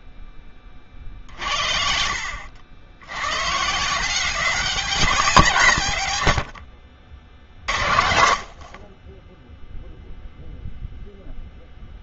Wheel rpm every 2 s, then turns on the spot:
10, 80, 180, 60, 50, 0.
6-8